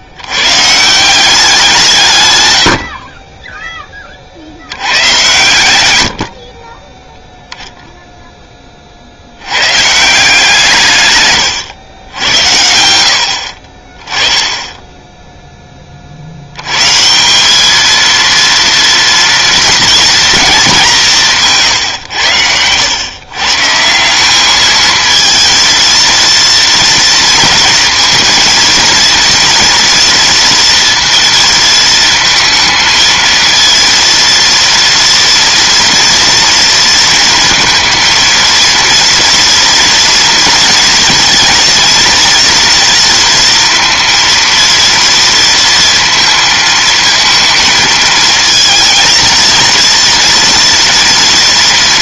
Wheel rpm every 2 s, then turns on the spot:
90, 80, 80, 30, 30, 150, 70, 10, 130, 230, 190, 110, 220, 230, 230, 230, 220, 240, 230, 230, 240, 230, 230, 230, 230, 240.
none